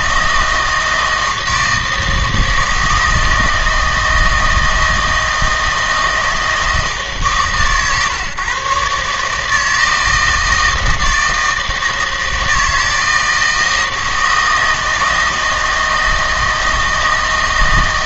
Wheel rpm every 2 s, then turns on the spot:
160, 160, 160, 160, 140, 160, 160, 160, 160.
none